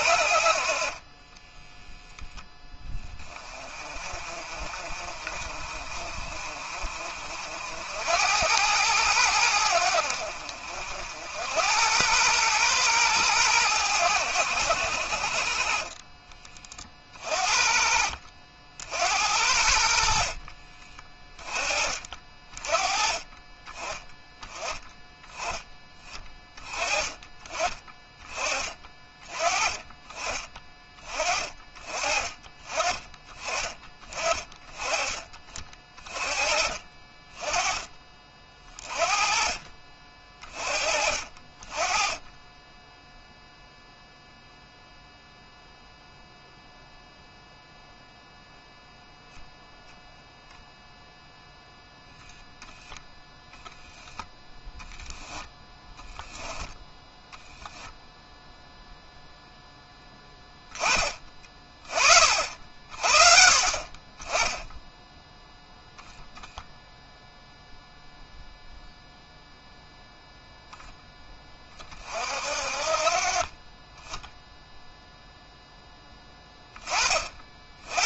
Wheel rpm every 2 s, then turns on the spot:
30, 20, 40, 50, 100, 70, 110, 70, 40, 60, 30, 30, 10, 20, 30, 30, 30, 20, 30, 30, 30, 10, 0, 0, 0, 0, 0, 10, 10, 0, 20, 60, 10, 0, 0, 10, 40, 0, 30.
none